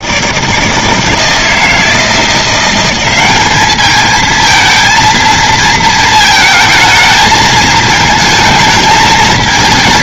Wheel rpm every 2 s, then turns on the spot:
160, 180, 220, 220, 220.
none